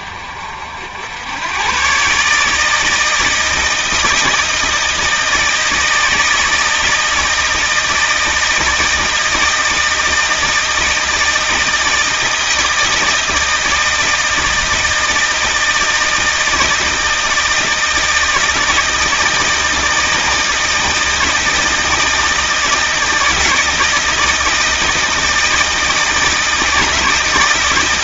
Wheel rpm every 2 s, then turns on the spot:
80, 160, 160, 160, 160, 160, 160, 160, 160, 160, 160, 160, 160, 160.
none